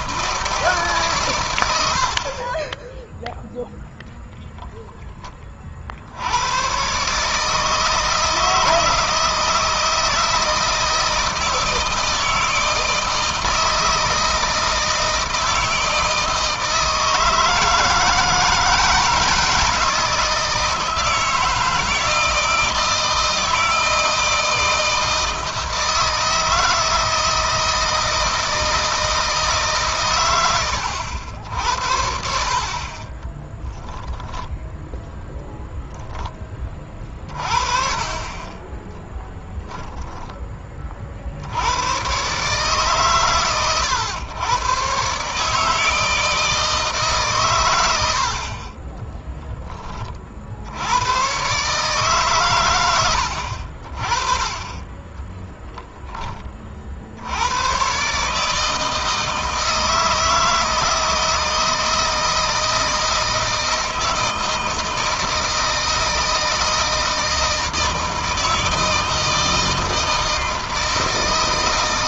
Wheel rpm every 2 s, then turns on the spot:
140, 20, 0, 120, 160, 160, 160, 160, 160, 160, 160, 160, 160, 160, 160, 90, 50, 10, 30, 20, 40, 140, 130, 150, 30, 90, 100, 20, 50, 160, 160, 160, 160, 160, 160, 160.
32-34 38-40 48-50 54-56